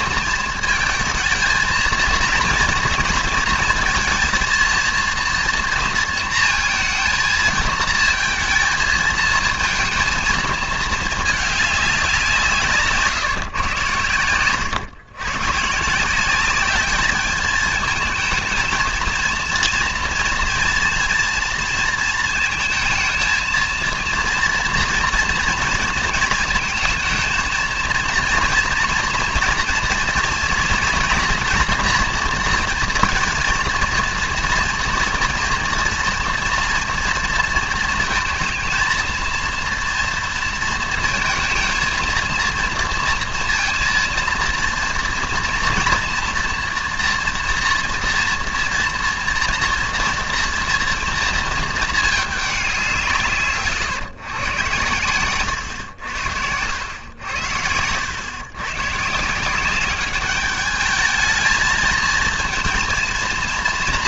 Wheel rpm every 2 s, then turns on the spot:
230, 230, 230, 230, 220, 220, 170, 110, 200, 230, 230, 220, 230, 230, 230, 230, 230, 230, 240, 230, 230, 230, 230, 230, 230, 230, 200, 110, 90, 130, 210, 230.
14-16